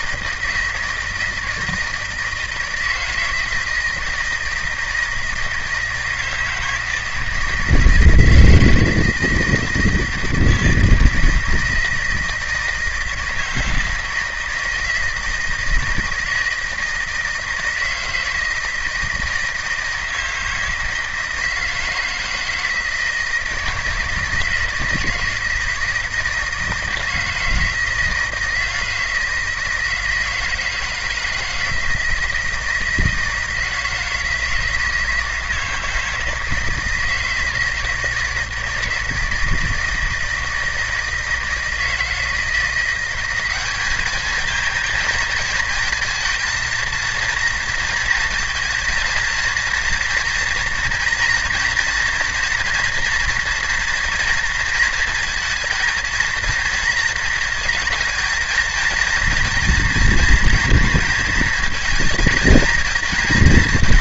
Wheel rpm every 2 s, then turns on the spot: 160, 160, 160, 160, 160, 160, 160, 160, 160, 160, 160, 160, 170, 160, 160, 160, 160, 160, 160, 160, 160, 180, 220, 230, 230, 230, 230, 230, 230, 230, 230, 230.
none